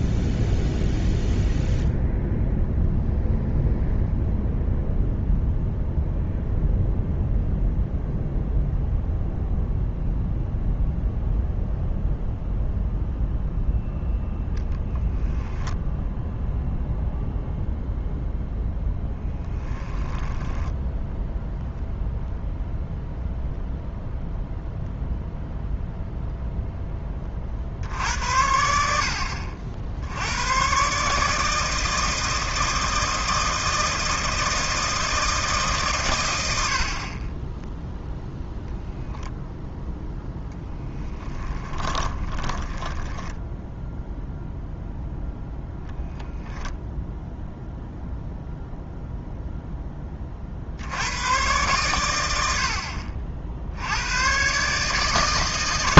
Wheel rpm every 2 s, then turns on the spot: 0, 0, 0, 0, 0, 0, 0, 0, 0, 0, 10, 0, 0, 10, 70, 130, 160, 160, 70, 10, 0, 10, 0, 0, 0, 60, 70, 130.
20-22 42-44